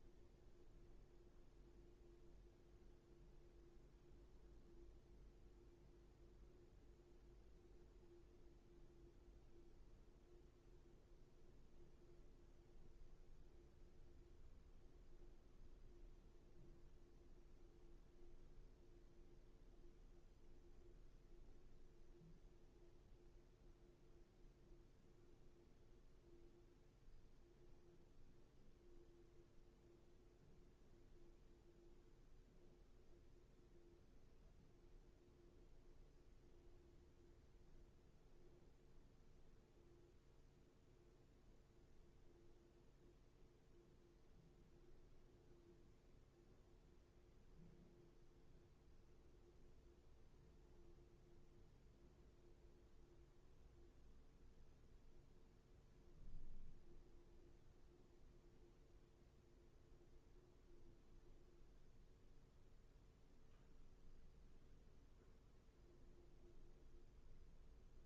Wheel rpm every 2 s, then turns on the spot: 0, 0, 0, 0, 0, 0, 0, 0, 0, 0, 0, 0, 0, 0, 0, 0, 0, 0, 0, 0, 0, 0, 0, 0, 0, 0, 0, 0, 0, 0, 0, 0, 0, 0.
none